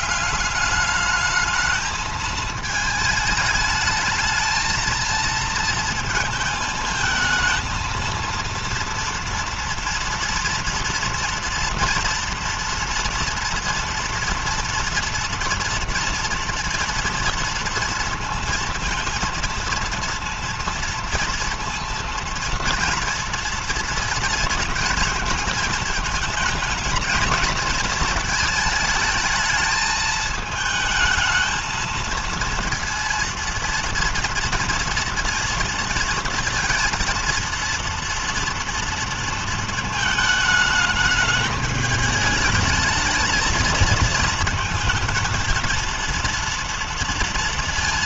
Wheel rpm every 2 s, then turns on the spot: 190, 220, 220, 220, 230, 230, 230, 230, 240, 230, 230, 230, 230, 220, 220, 220, 230, 230, 230, 230, 220, 210, 220, 230.
none